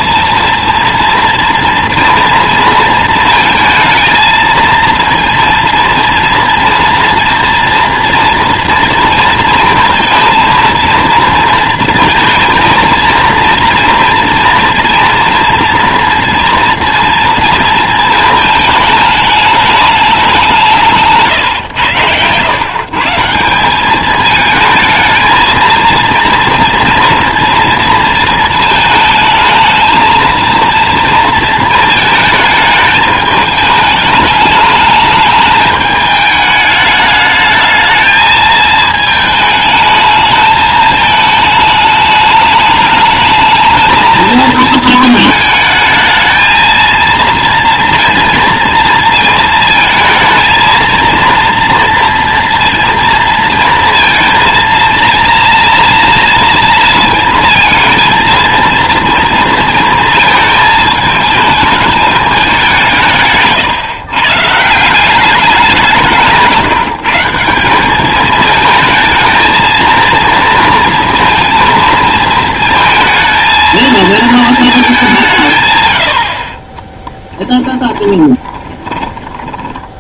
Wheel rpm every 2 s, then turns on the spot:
230, 230, 230, 240, 230, 230, 230, 230, 230, 220, 180, 140, 220, 230, 220, 230, 220, 210, 210, 220, 220, 210, 220, 230, 230, 230, 230, 230, 230, 230, 220, 170, 160, 160, 220, 230, 220, 210, 20, 20.
78-80